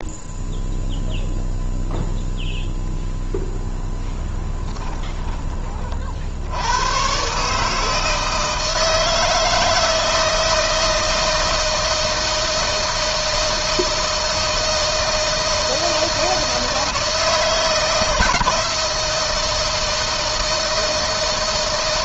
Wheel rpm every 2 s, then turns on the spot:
0, 0, 10, 80, 160, 160, 160, 160, 160, 160, 160.
4-6